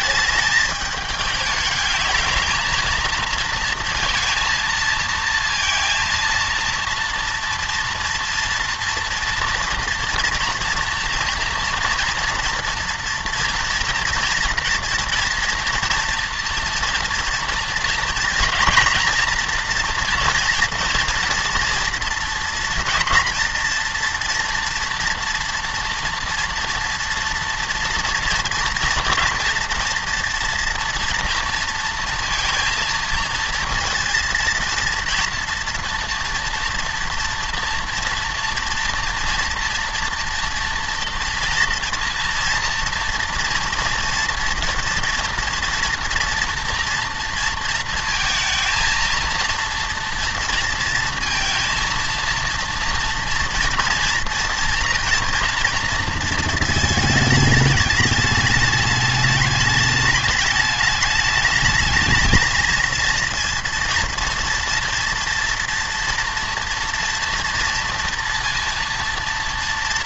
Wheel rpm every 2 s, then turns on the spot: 210, 230, 230, 230, 230, 230, 230, 230, 230, 230, 230, 240, 240, 230, 240, 230, 230, 230, 240, 230, 230, 230, 230, 230, 230, 230, 230, 230, 220, 210, 210, 230, 230, 230, 230.
none